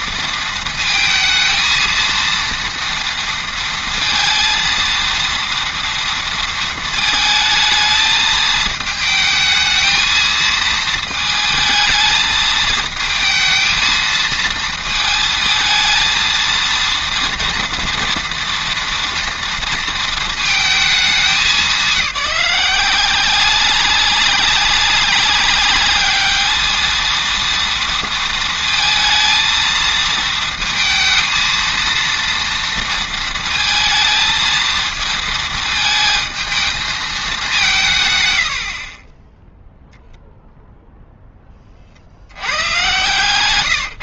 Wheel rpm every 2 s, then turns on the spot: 220, 230, 230, 230, 220, 220, 220, 230, 230, 230, 220, 180, 200, 220, 230, 230, 230, 230, 220, 50, 0, 110.
none